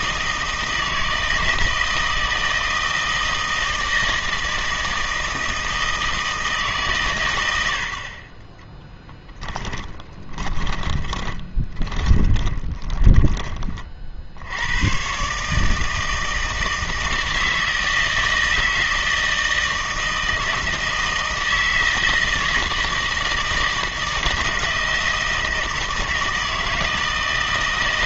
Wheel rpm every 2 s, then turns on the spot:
160, 160, 160, 140, 10, 20, 20, 120, 160, 160, 160, 160, 160, 160.
8-14